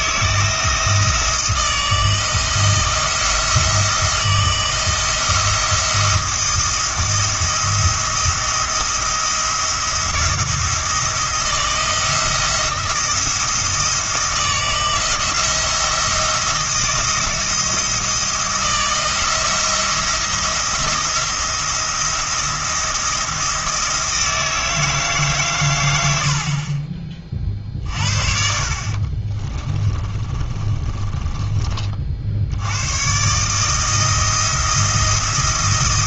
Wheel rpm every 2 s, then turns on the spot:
160, 160, 170, 170, 170, 170, 170, 170, 170, 160, 170, 170, 160, 40, 50, 30, 100, 170.
28-32